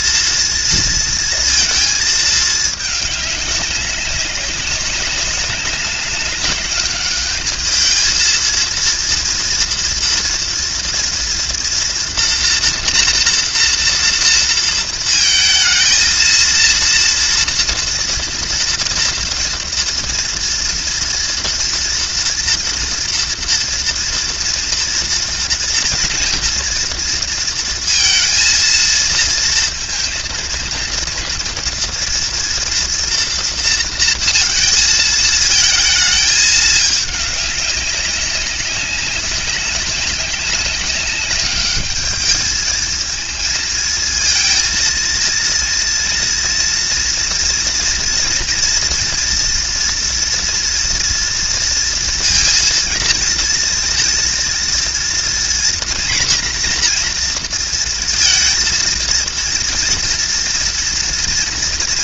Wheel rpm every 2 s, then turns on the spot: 230, 210, 200, 200, 230, 230, 240, 230, 230, 230, 230, 230, 230, 230, 220, 220, 230, 220, 210, 190, 200, 220, 230, 230, 230, 230, 230, 230, 240, 230, 230.
none